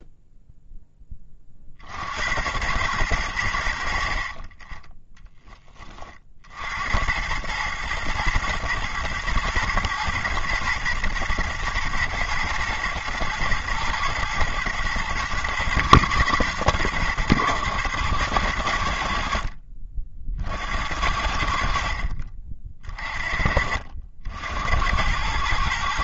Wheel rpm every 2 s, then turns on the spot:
0, 100, 30, 60, 110, 110, 120, 110, 110, 100, 60, 50, 80.
4-6